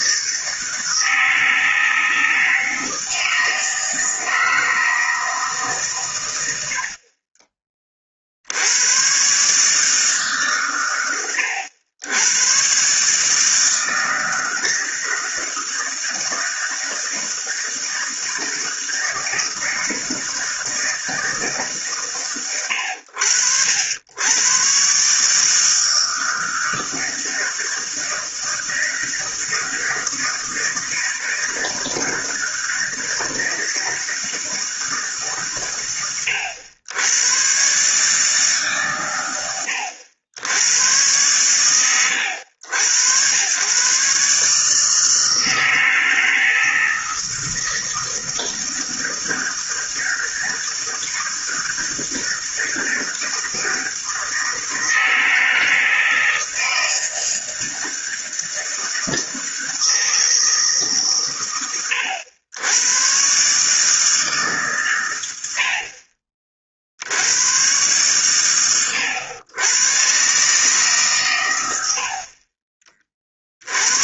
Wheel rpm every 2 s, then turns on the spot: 160, 160, 160, 90, 70, 140, 120, 160, 160, 160, 160, 110, 110, 160, 160, 160, 160, 160, 100, 150, 90, 90, 150, 160, 160, 160, 160, 160, 160, 160, 160, 100, 140, 40, 120, 140, 40.
none